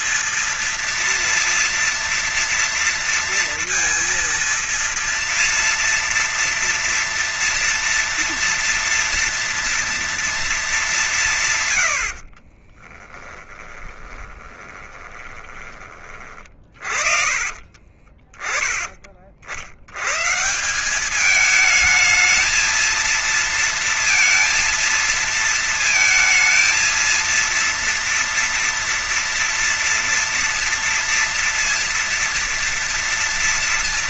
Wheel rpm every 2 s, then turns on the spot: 230, 230, 230, 230, 230, 220, 50, 20, 30, 30, 150, 220, 230, 220, 230, 230, 230.
12-16